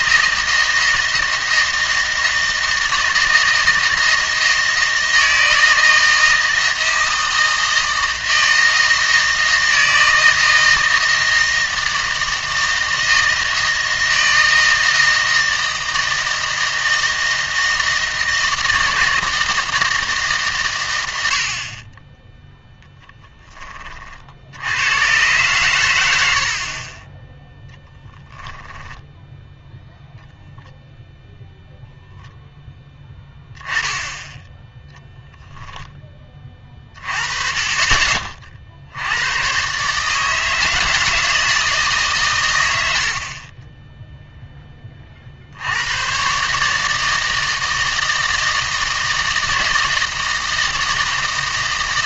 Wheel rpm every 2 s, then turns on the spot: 160, 160, 160, 160, 160, 160, 160, 160, 160, 160, 130, 0, 80, 60, 10, 0, 0, 0, 30, 50, 160, 100, 20, 150, 160, 160.
28-30